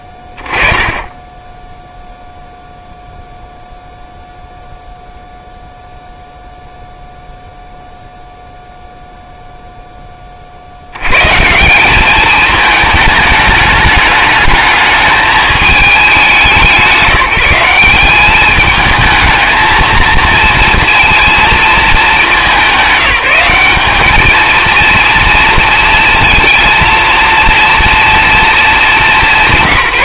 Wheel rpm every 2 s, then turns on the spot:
20, 0, 0, 0, 0, 40, 210, 210, 180, 210, 230, 190, 230, 230, 220.
none